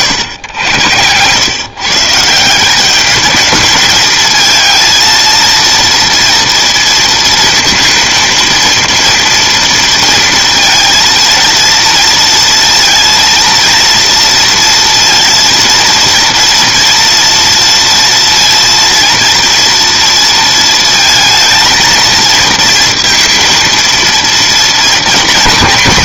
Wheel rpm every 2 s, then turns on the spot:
100, 200, 230, 230, 230, 230, 230, 230, 230, 230, 220, 230, 220.
none